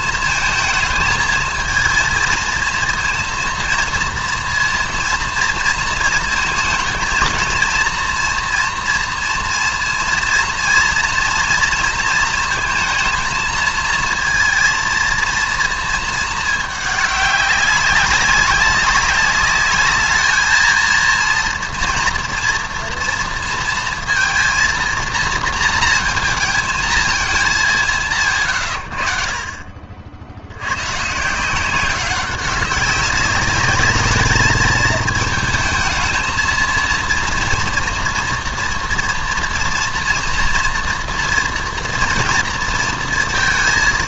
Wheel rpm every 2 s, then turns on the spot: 220, 230, 230, 230, 230, 230, 230, 230, 220, 200, 220, 240, 230, 220, 110, 110, 190, 220, 220, 230, 230, 230.
none